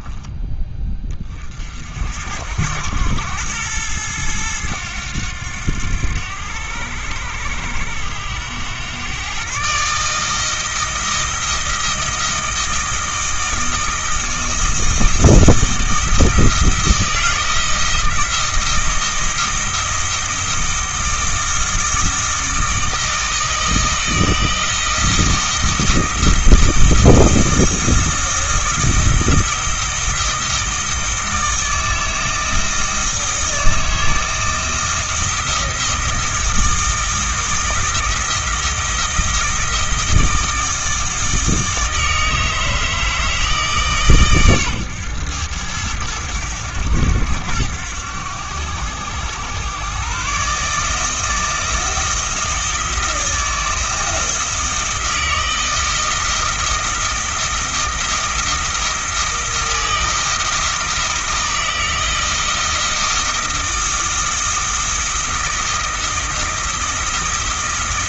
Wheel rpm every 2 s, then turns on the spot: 20, 90, 100, 90, 100, 160, 160, 160, 160, 160, 160, 160, 160, 170, 170, 160, 160, 170, 160, 160, 160, 160, 110, 100, 100, 150, 160, 160, 160, 170, 160, 160, 160, 160.
none